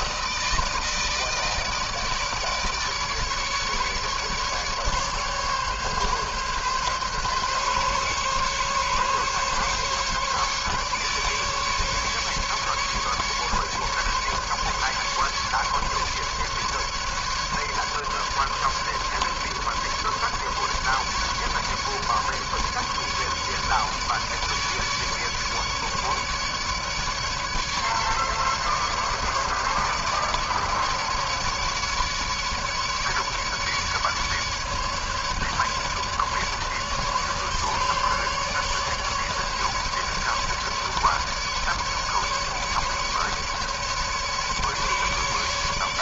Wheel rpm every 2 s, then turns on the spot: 160, 150, 150, 140, 140, 150, 150, 150, 150, 150, 150, 140, 150, 150, 140, 150, 150, 150, 150, 150, 150, 150, 150.
none